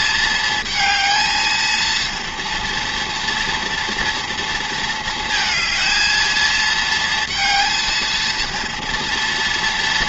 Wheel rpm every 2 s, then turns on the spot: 220, 230, 220, 220, 230.
none